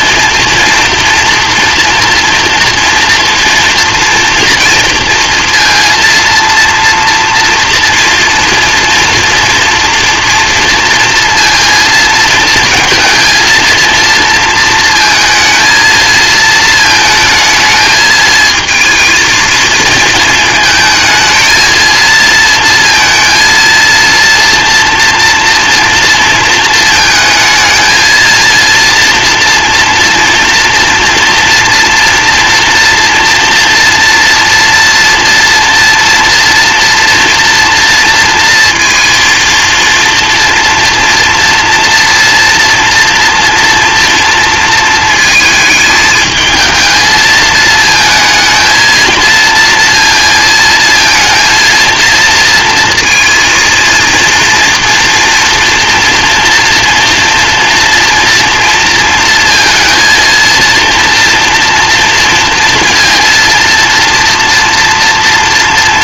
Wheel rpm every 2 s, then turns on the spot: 230, 230, 230, 240, 230, 230, 230, 230, 230, 220, 220, 230, 230, 230, 230, 230, 230, 240, 240, 230, 240, 230, 230, 220, 230, 230, 230, 230, 240, 230, 230, 230, 240.
none